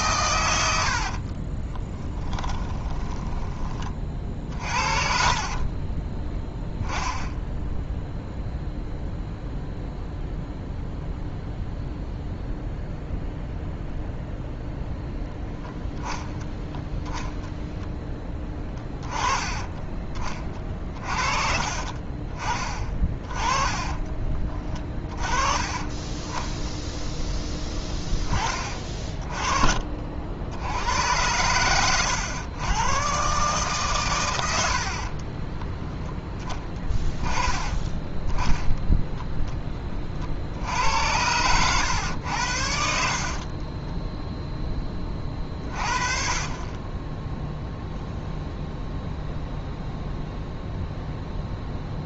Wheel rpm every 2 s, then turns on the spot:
80, 10, 50, 10, 0, 0, 0, 0, 10, 20, 30, 30, 30, 0, 30, 80, 110, 70, 20, 10, 70, 70, 20, 30, 0, 0.
2-4 20-22 42-44